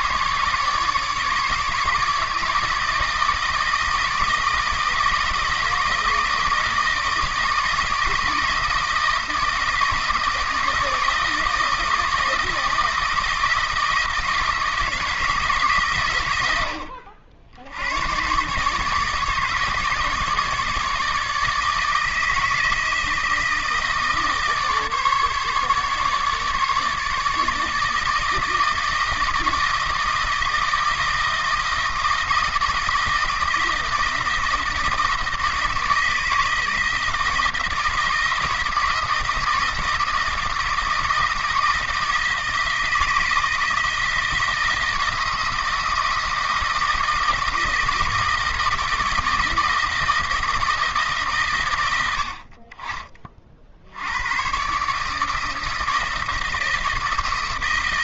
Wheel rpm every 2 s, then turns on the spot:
150, 160, 160, 160, 160, 160, 160, 160, 80, 140, 150, 160, 150, 150, 160, 160, 160, 160, 160, 160, 160, 160, 160, 160, 160, 160, 40, 130, 160.
none